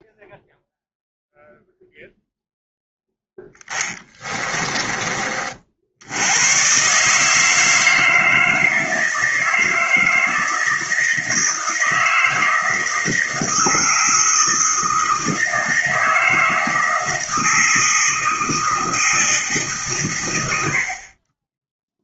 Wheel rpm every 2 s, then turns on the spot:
0, 0, 30, 140, 160, 160, 160, 160, 160, 160, 50.
none